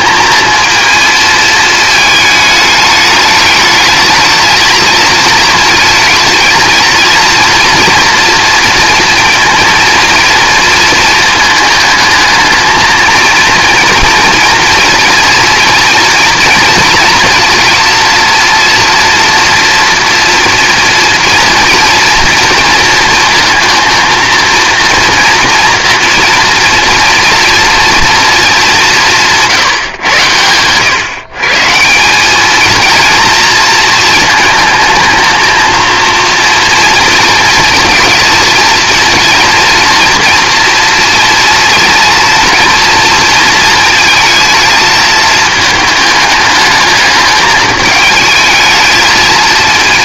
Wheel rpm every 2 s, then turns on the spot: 230, 210, 220, 220, 230, 230, 220, 230, 230, 240, 230, 230, 230, 240, 210, 110, 220, 220, 230, 230, 230, 230, 220, 210, 220.
none